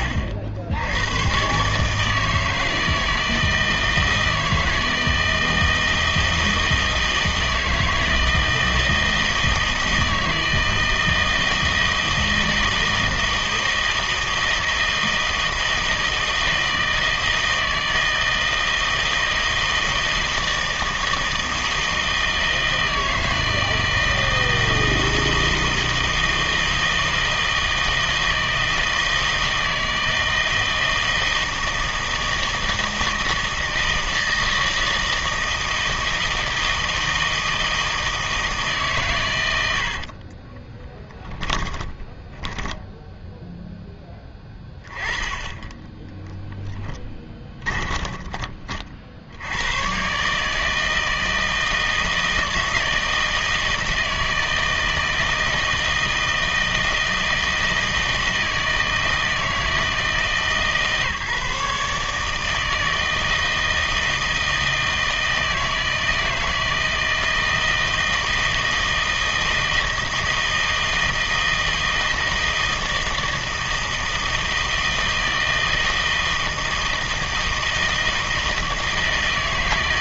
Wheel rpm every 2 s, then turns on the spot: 80, 160, 160, 160, 160, 160, 160, 160, 160, 160, 160, 160, 160, 160, 160, 160, 160, 160, 160, 150, 30, 10, 20, 10, 40, 160, 160, 160, 160, 160, 150, 160, 160, 160, 160, 160, 160, 160, 160, 160.
40-44 46-48